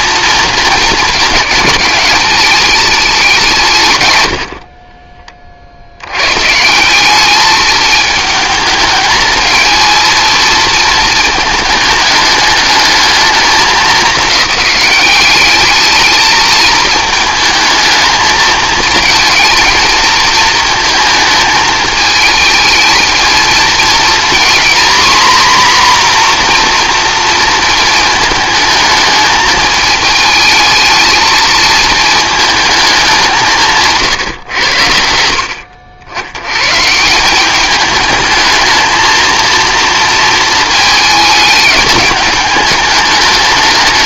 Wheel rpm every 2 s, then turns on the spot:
230, 210, 50, 160, 220, 220, 210, 200, 220, 220, 230, 220, 240, 240, 220, 220, 210, 100, 120, 220, 220, 210.
4-6 34-36